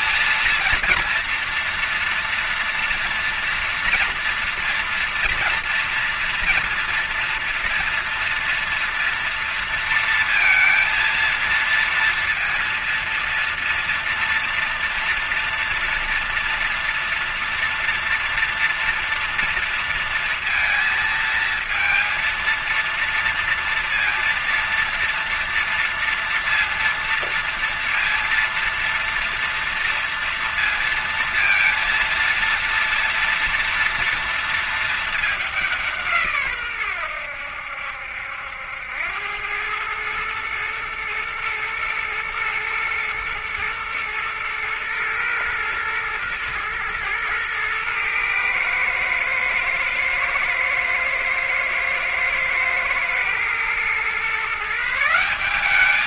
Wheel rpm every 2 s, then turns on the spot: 230, 230, 230, 230, 230, 230, 230, 230, 230, 240, 230, 230, 230, 230, 230, 230, 230, 230, 130, 80, 110, 110, 110, 120, 110, 110, 110, 150.
none